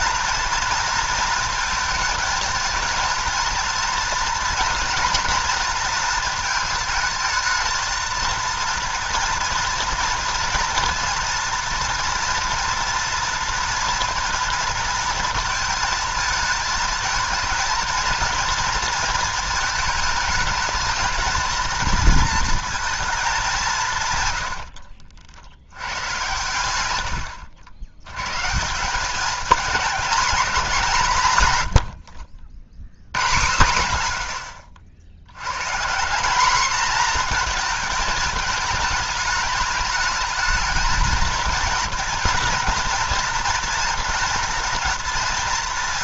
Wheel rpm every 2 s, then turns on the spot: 230, 220, 240, 220, 230, 230, 230, 230, 230, 230, 220, 230, 80, 100, 160, 210, 70, 60, 230, 210, 220, 220, 230.
24-26